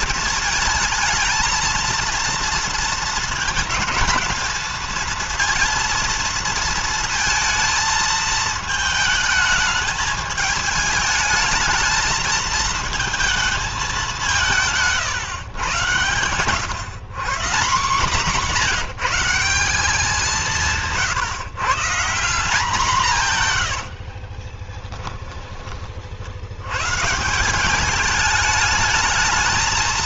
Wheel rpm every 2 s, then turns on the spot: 220, 230, 230, 230, 220, 220, 220, 150, 110, 200, 170, 170, 20, 100, 210.
14-16 24-26